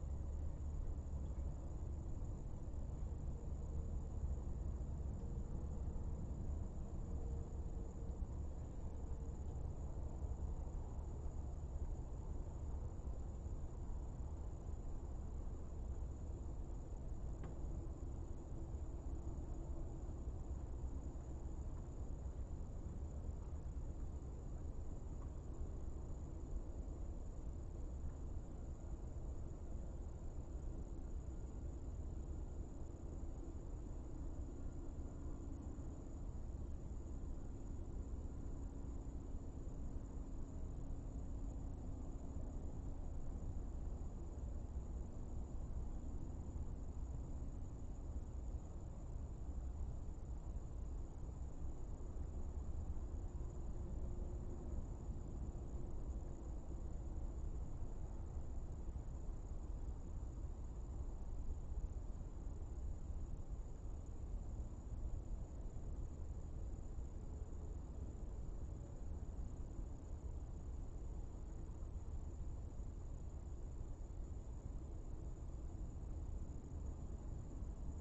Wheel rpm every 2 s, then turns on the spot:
0, 0, 0, 0, 0, 0, 0, 0, 0, 0, 0, 0, 0, 0, 0, 0, 0, 0, 0, 0, 0, 0, 0, 0, 0, 0, 0, 0, 0, 0, 0, 0, 0, 0, 0, 0, 0, 0, 0.
none